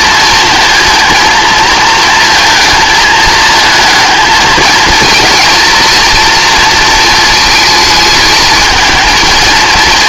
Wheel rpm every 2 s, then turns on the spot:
230, 230, 220, 230, 220.
none